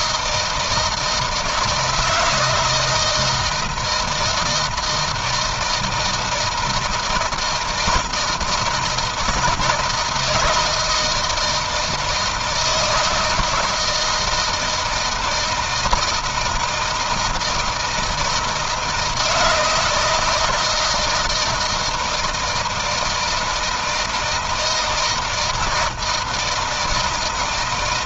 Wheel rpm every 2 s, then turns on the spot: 160, 160, 160, 160, 170, 160, 160, 160, 160, 160, 160, 160, 160, 160.
none